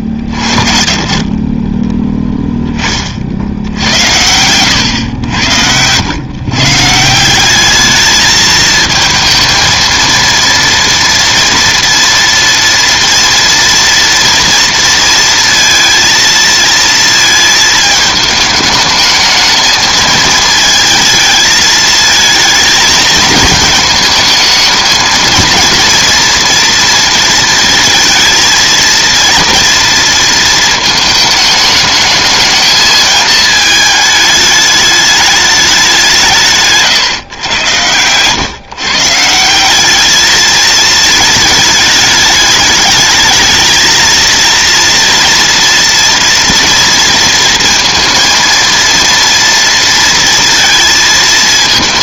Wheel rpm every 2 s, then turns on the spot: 40, 20, 100, 140, 220, 230, 230, 230, 230, 220, 220, 220, 220, 230, 230, 220, 220, 210, 150, 140, 220, 210, 230, 230, 230, 230.
36-38